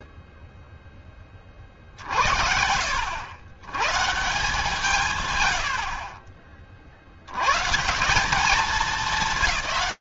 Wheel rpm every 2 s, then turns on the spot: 0, 70, 170, 40, 200.
none